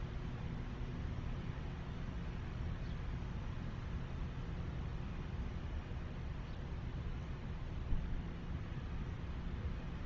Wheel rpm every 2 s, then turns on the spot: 0, 0, 0, 0, 0.
none